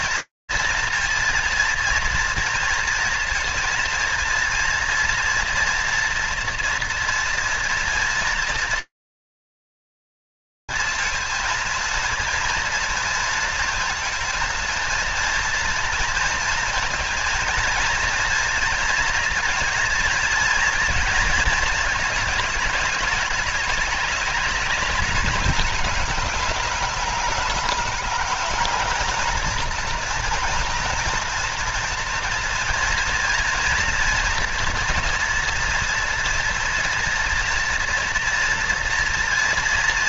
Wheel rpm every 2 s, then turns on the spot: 230, 230, 240, 230, 230, 230, 220, 230, 230, 230, 210, 210, 210, 210, 230, 230, 240, 240, 230, 240.
none